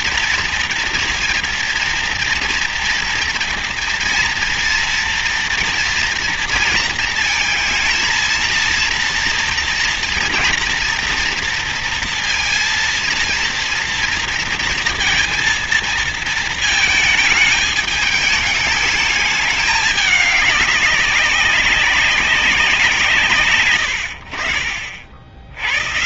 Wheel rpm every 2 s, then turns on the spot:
230, 230, 230, 230, 230, 240, 230, 230, 220, 210, 200, 200, 90.
none